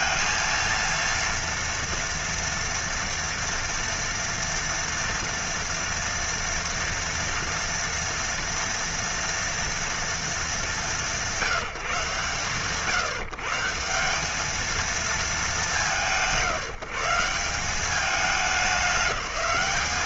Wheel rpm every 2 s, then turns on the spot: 230, 230, 240, 240, 230, 220, 110, 210, 120, 200.
none